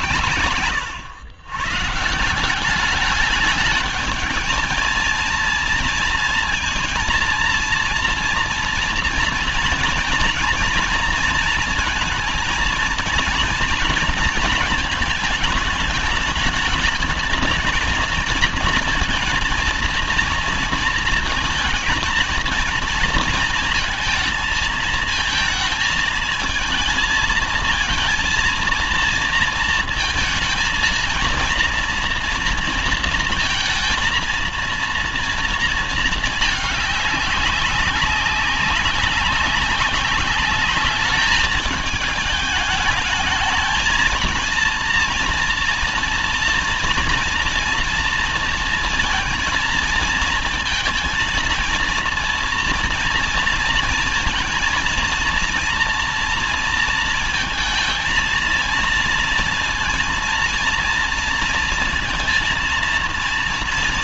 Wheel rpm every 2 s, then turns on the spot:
110, 190, 220, 230, 240, 240, 230, 220, 220, 230, 230, 220, 220, 220, 230, 230, 230, 230, 220, 200, 200, 220, 230, 230, 230, 230, 230, 230, 230, 230, 230, 230.
0-2